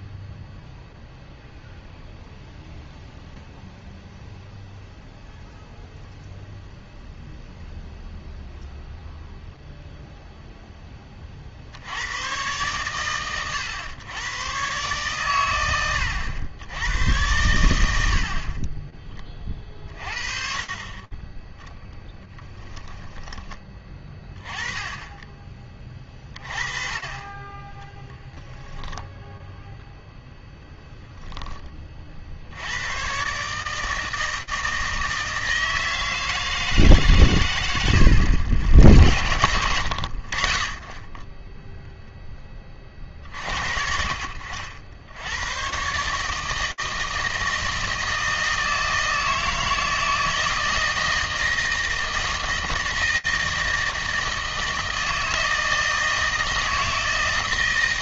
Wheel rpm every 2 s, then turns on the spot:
0, 0, 0, 0, 0, 10, 120, 120, 110, 30, 30, 10, 20, 40, 10, 0, 80, 160, 150, 60, 30, 20, 70, 160, 160, 160, 160, 160, 160.
18-20 22-24 28-30